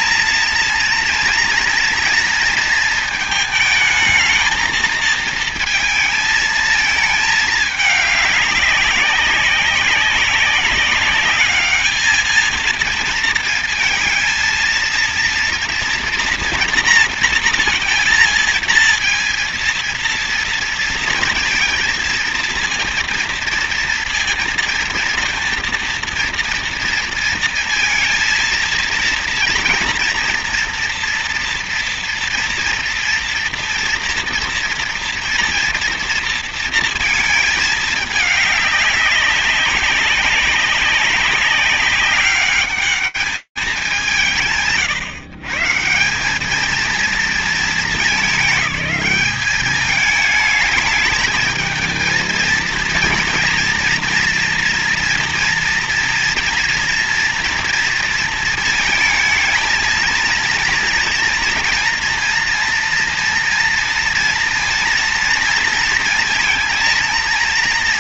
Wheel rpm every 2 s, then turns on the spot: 230, 230, 220, 220, 200, 200, 220, 230, 230, 230, 230, 230, 230, 230, 230, 240, 230, 230, 230, 210, 190, 200, 140, 220, 200, 210, 230, 230, 230, 220, 230, 230, 230, 230.
none